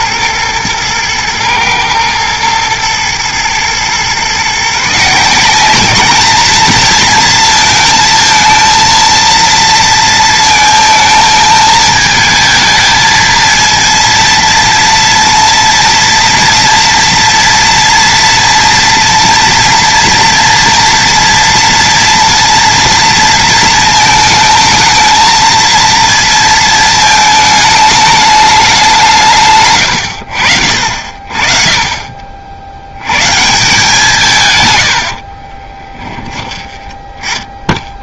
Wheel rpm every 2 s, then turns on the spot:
110, 110, 150, 230, 230, 230, 220, 230, 230, 230, 230, 230, 220, 220, 190, 60, 70, 110, 20.
34-36